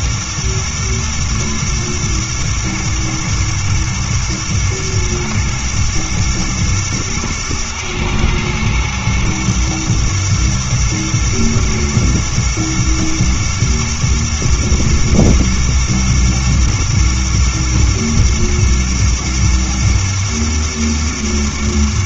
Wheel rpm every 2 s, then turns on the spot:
110, 110, 120, 110, 110, 110, 120, 110, 110, 120, 110.
none